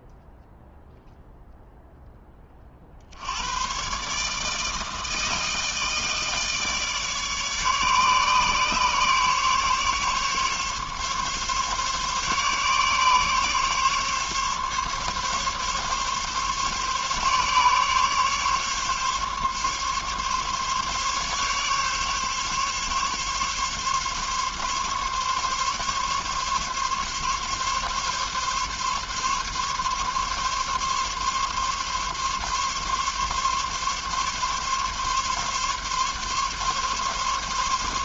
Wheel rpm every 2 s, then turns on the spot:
0, 40, 160, 150, 140, 140, 140, 140, 140, 140, 140, 140, 140, 140, 140, 140, 140, 140, 140.
none